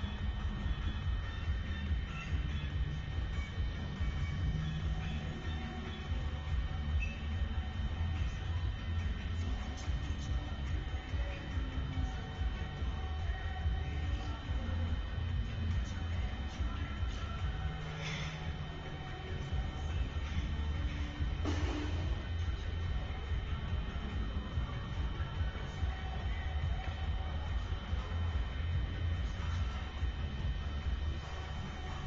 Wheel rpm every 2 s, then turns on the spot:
0, 0, 0, 0, 0, 0, 0, 0, 0, 0, 0, 0, 0, 0, 0, 0.
none